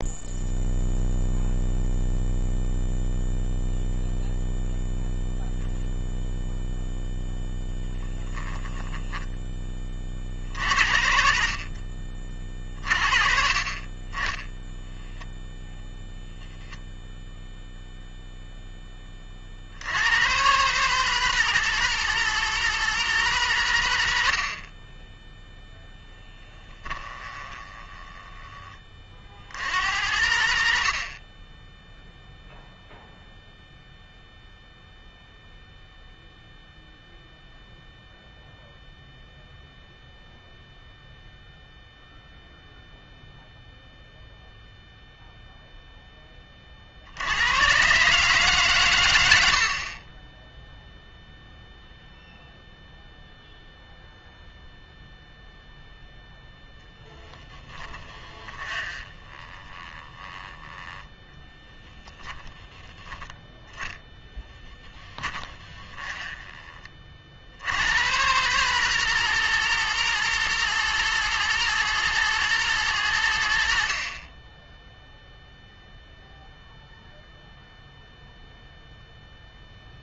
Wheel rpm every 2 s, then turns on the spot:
0, 0, 0, 0, 10, 90, 40, 0, 0, 20, 140, 170, 30, 20, 40, 80, 0, 0, 0, 0, 0, 0, 0, 50, 120, 0, 0, 0, 10, 30, 10, 10, 10, 30, 160, 160, 140, 10, 0, 0.
8-10 26-28 56-62 64-66